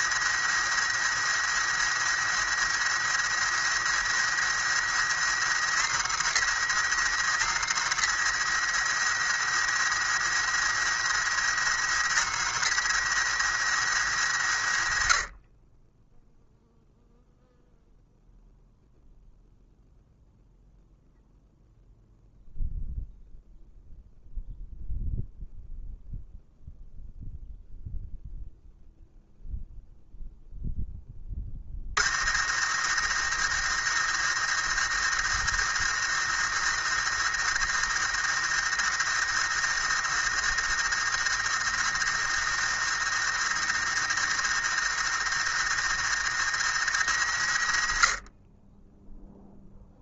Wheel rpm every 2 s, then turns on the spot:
110, 110, 110, 120, 110, 110, 120, 80, 0, 0, 0, 0, 0, 0, 0, 0, 90, 110, 110, 110, 110, 110, 110, 110, 20.
none